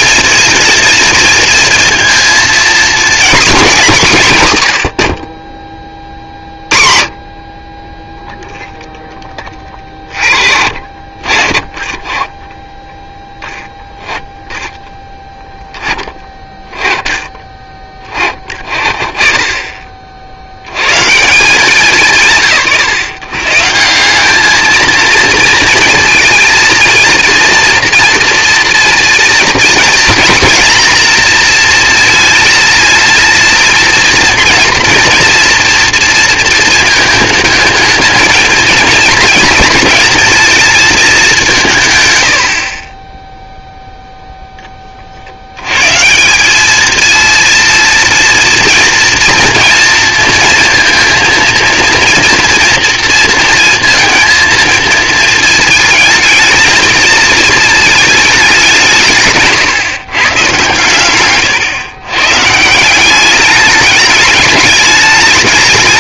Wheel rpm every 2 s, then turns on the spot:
230, 230, 140, 40, 0, 40, 10, 0, 10, 30, 70, 150, 210, 230, 230, 240, 230, 230, 230, 220, 230, 80, 10, 190, 230, 230, 230, 230, 220, 200, 130, 150, 210.
none